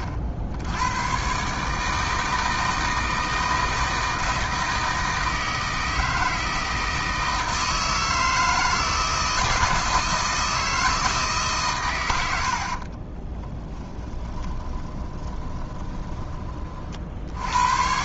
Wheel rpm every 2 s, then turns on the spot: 60, 160, 160, 160, 160, 160, 50, 20, 40.
12-16